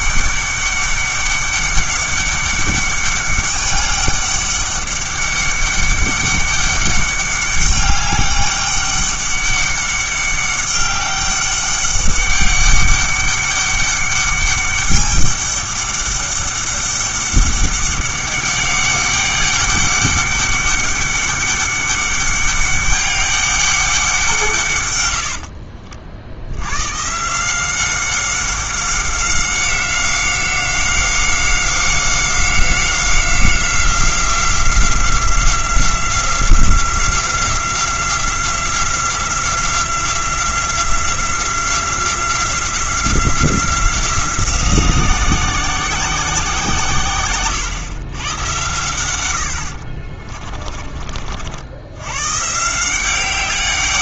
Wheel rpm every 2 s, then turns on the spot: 200, 200, 200, 200, 200, 200, 200, 200, 200, 200, 200, 200, 140, 100, 190, 190, 180, 180, 180, 180, 180, 180, 180, 150, 110, 30, 160.
50-52